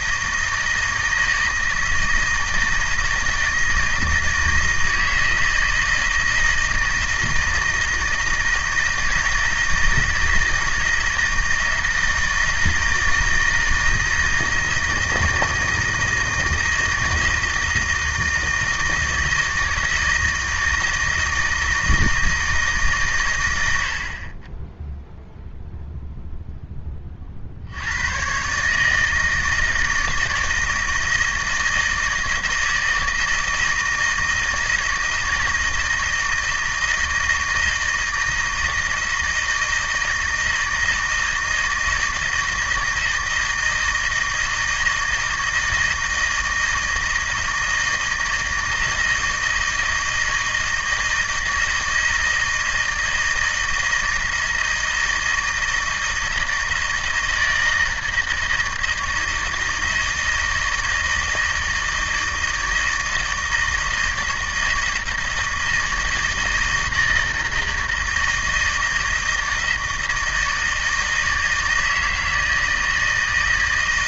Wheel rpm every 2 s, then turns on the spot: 160, 160, 160, 160, 160, 160, 160, 160, 160, 160, 160, 150, 10, 10, 140, 160, 160, 160, 160, 160, 160, 160, 160, 160, 160, 160, 160, 160, 160, 160, 160, 160, 160, 160, 160, 160, 160.
none